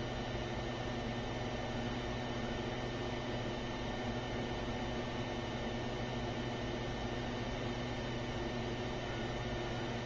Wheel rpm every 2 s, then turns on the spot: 0, 0, 0, 0, 0.
none